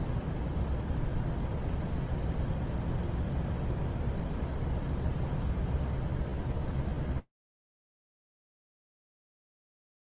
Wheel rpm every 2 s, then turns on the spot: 0, 0, 0, 0, 0.
none